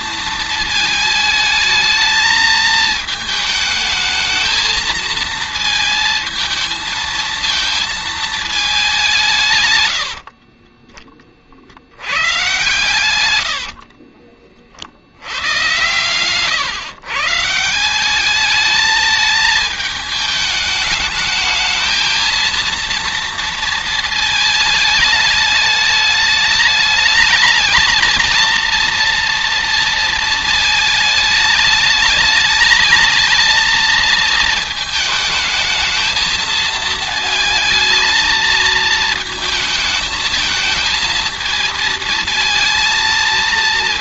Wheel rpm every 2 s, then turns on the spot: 220, 220, 220, 220, 200, 20, 120, 50, 140, 210, 210, 230, 220, 210, 230, 220, 220, 220, 220, 220, 220, 230.
none